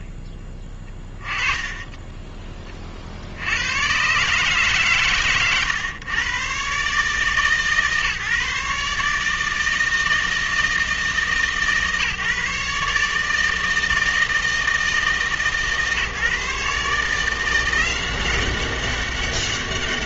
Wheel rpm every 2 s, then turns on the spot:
20, 20, 140, 140, 150, 160, 150, 160, 150, 190.
0-2